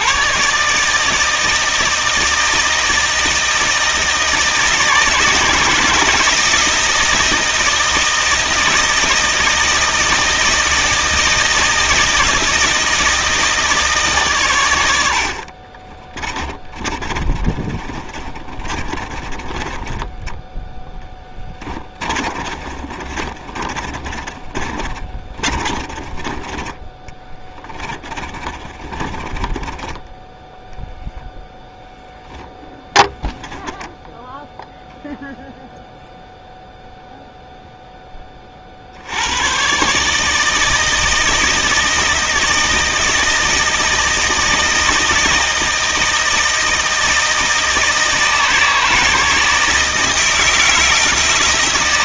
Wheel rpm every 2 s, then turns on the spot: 160, 160, 160, 160, 160, 160, 160, 60, 30, 30, 10, 30, 30, 20, 20, 0, 10, 0, 0, 50, 160, 160, 160, 160, 160, 160.
16-20 22-26 28-30 32-34